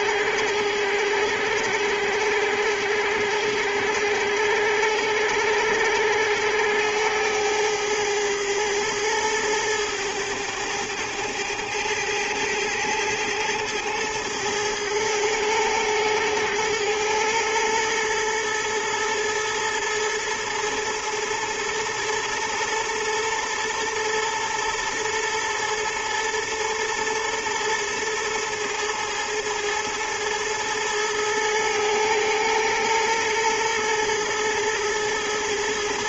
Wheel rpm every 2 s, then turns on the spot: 90, 90, 100, 100, 110, 110, 110, 110, 110, 110, 110, 110, 110, 120, 110, 110, 110, 110.
none